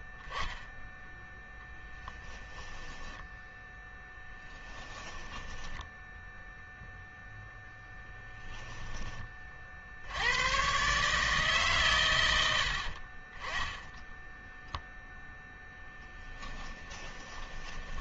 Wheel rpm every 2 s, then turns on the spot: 10, 10, 10, 0, 10, 140, 70, 0, 10.
2-6 8-10 16-18